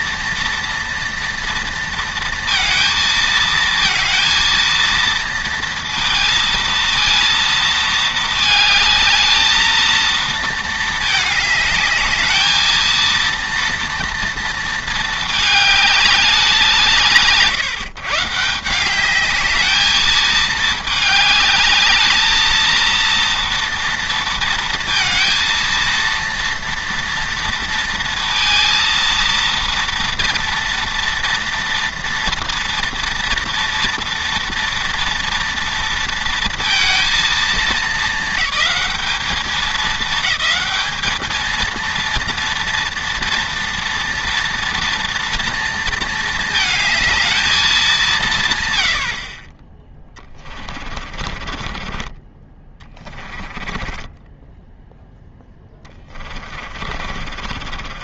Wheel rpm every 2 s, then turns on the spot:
230, 230, 230, 230, 220, 220, 220, 230, 170, 170, 220, 220, 230, 230, 230, 230, 230, 230, 230, 210, 210, 230, 230, 220, 150, 30, 20, 0, 40.
50-54 56-58